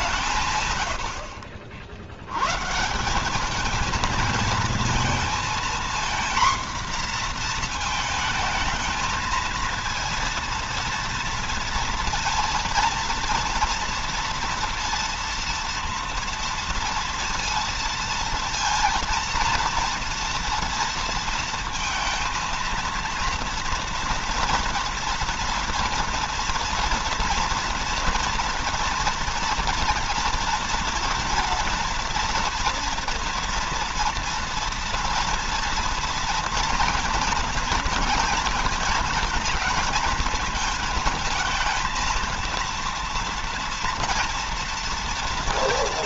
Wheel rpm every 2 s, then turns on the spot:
120, 140, 220, 240, 220, 230, 230, 230, 230, 230, 230, 230, 230, 230, 230, 230, 230, 230, 230, 230, 220, 230, 230.
none